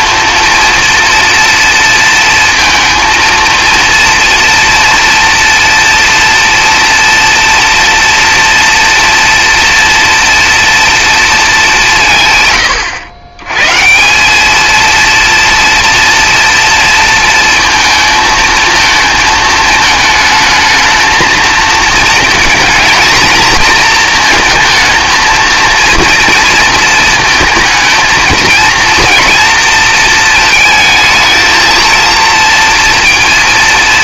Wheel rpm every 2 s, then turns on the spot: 240, 230, 230, 230, 230, 230, 120, 220, 230, 230, 220, 220, 230, 230, 230, 220, 230.
none